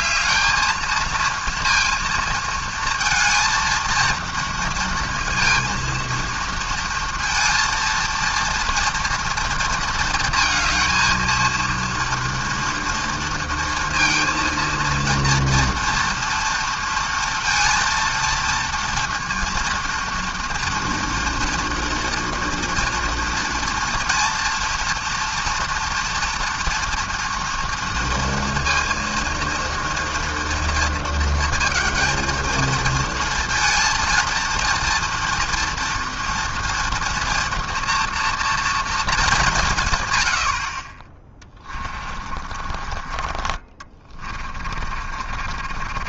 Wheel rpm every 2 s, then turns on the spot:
220, 220, 230, 230, 230, 230, 230, 230, 230, 230, 230, 230, 230, 230, 230, 230, 230, 230, 230, 230, 60, 40, 40.
42-46